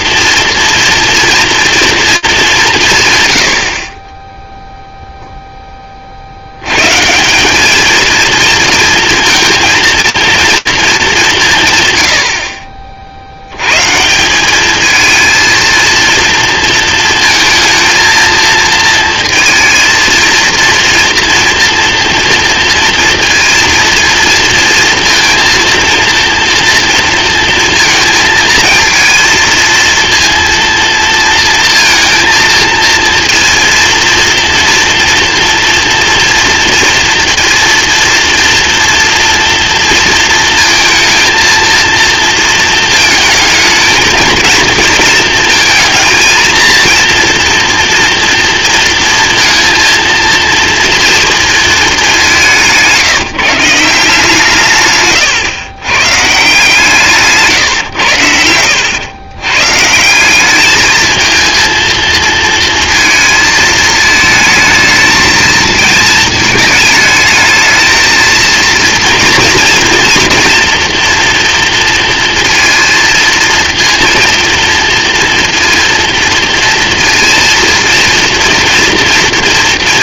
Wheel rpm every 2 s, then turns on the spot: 230, 170, 0, 110, 230, 220, 60, 220, 230, 230, 230, 230, 230, 230, 230, 230, 230, 230, 230, 230, 220, 220, 220, 230, 230, 230, 160, 150, 160, 90, 220, 230, 220, 220, 230, 230, 230, 230, 230, 240.
none